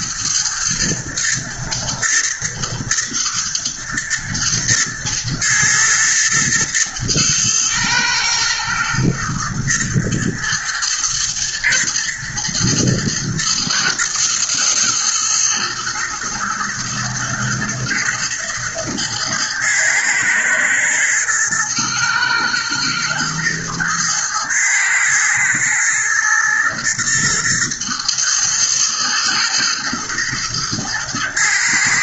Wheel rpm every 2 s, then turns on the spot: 120, 120, 120, 120, 120, 110, 110, 110, 110, 110, 110, 110, 110, 110, 120, 110.
none